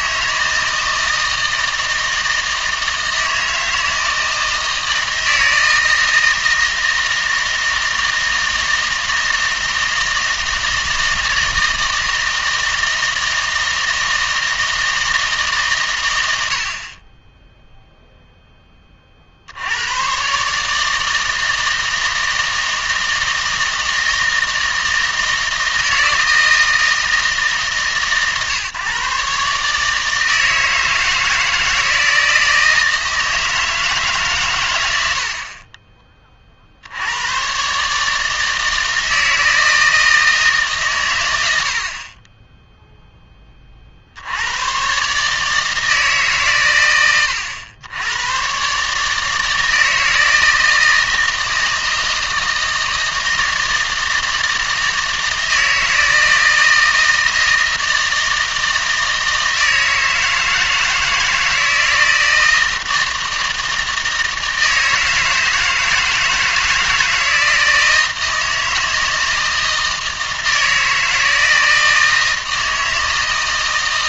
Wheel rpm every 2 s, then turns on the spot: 160, 160, 160, 160, 160, 160, 160, 160, 50, 20, 150, 160, 160, 160, 140, 160, 160, 110, 70, 160, 150, 20, 100, 120, 130, 160, 160, 160, 160, 160, 160, 160, 160, 160, 160, 160, 160.
none